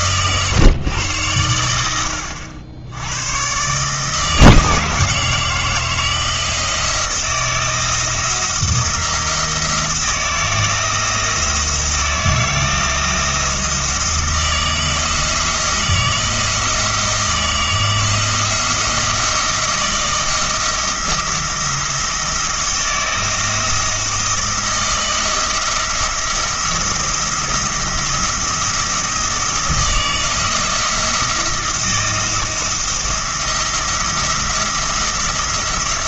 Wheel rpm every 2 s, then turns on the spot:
120, 90, 160, 170, 170, 160, 170, 160, 160, 170, 160, 160, 170, 170, 170, 170, 170, 170.
none